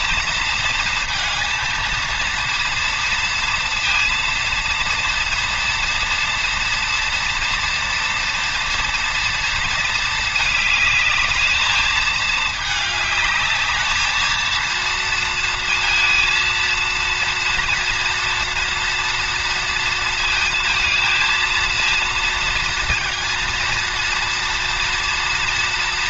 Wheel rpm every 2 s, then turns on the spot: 230, 230, 230, 230, 230, 210, 210, 230, 230, 240, 230, 230, 230.
none